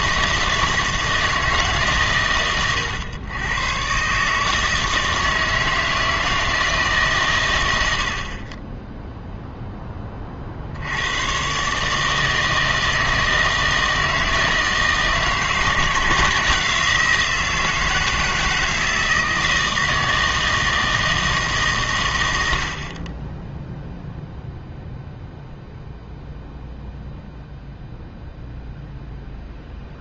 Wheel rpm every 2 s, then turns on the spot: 160, 120, 150, 160, 20, 60, 160, 160, 170, 160, 160, 70, 0, 0, 0.
none